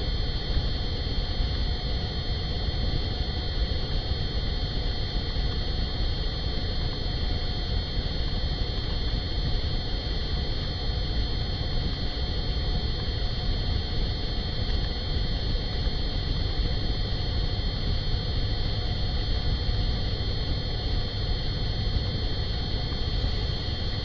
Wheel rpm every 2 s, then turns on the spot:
0, 0, 0, 0, 0, 0, 0, 0, 0, 0, 0, 0.
none